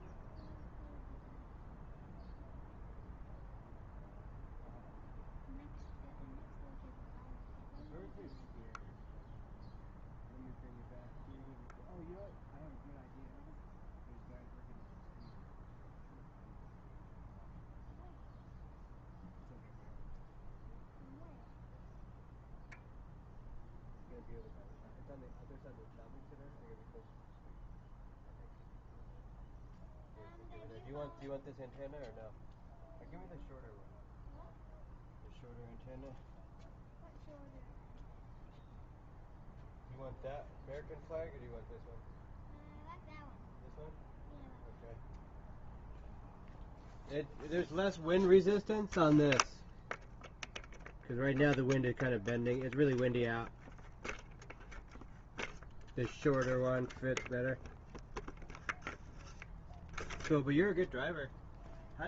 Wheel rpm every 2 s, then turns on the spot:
0, 0, 0, 0, 0, 0, 0, 0, 0, 0, 0, 0, 0, 0, 0, 0, 0, 0, 0, 0, 0, 0, 0, 0, 0, 0, 0, 0, 0, 0, 0.
none